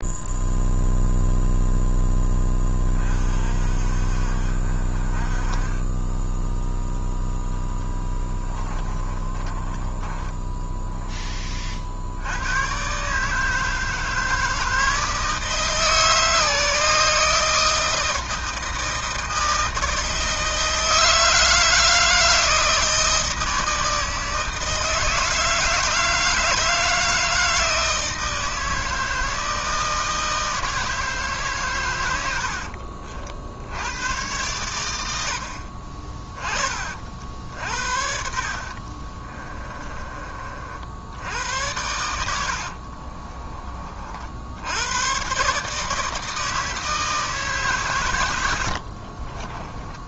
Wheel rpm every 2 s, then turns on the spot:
0, 20, 50, 0, 20, 20, 120, 160, 150, 160, 160, 160, 160, 160, 160, 160, 70, 100, 40, 40, 60, 60, 100, 160, 60.
8-12 32-34 38-40 42-44 48-50